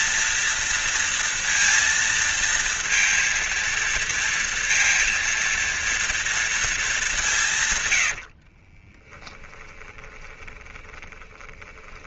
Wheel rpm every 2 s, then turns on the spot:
230, 230, 230, 210, 30, 20.
8-12